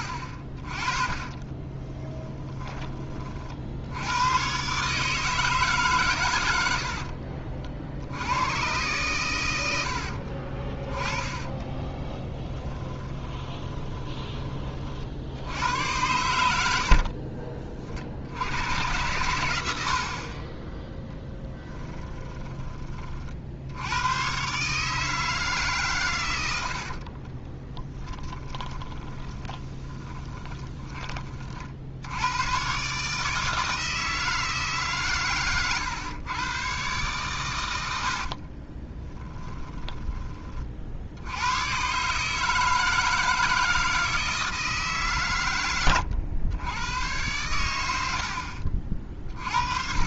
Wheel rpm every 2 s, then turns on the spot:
40, 20, 130, 80, 110, 30, 20, 40, 80, 100, 10, 20, 150, 60, 20, 20, 130, 150, 120, 40, 50, 160, 150, 100, 50.
2-4 10-14 16-18 26-32 38-40